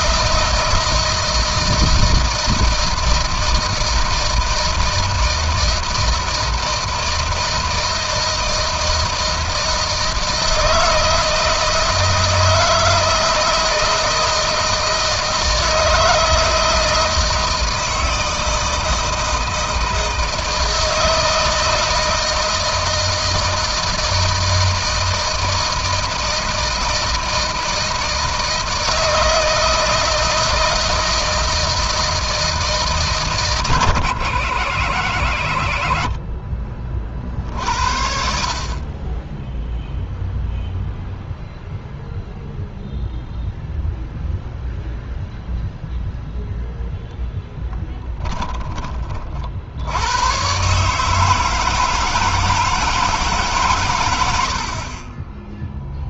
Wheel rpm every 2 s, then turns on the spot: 160, 160, 160, 160, 160, 160, 160, 160, 160, 160, 160, 160, 160, 160, 160, 160, 160, 90, 40, 30, 0, 0, 0, 0, 20, 140, 160, 60.
none